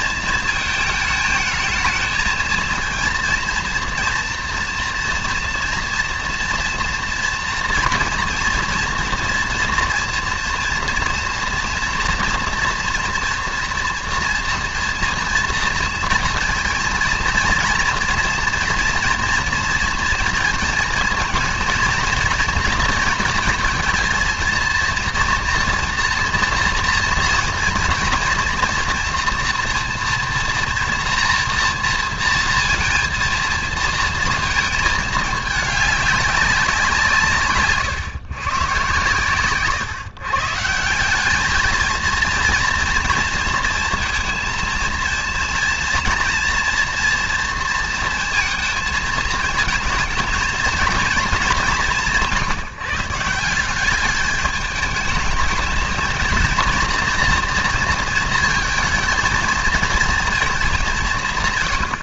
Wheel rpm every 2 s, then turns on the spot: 220, 230, 240, 240, 230, 240, 230, 230, 230, 230, 230, 230, 230, 230, 240, 240, 230, 220, 190, 130, 160, 230, 220, 230, 230, 230, 170, 210, 230, 230, 210.
none